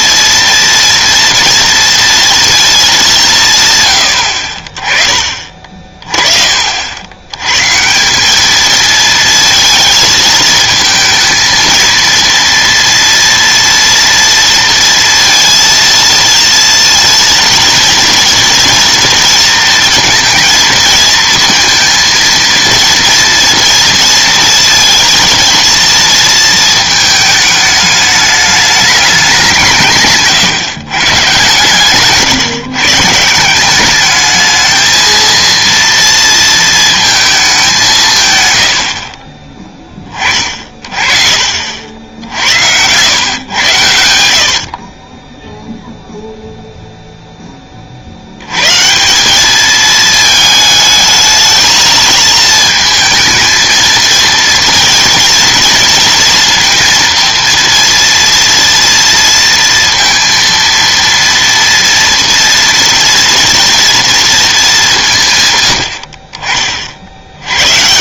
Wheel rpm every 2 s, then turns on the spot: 230, 220, 40, 40, 220, 220, 230, 230, 230, 230, 230, 230, 230, 220, 210, 160, 140, 220, 230, 120, 50, 80, 50, 0, 120, 220, 220, 230, 230, 230, 230, 230, 220, 40.
none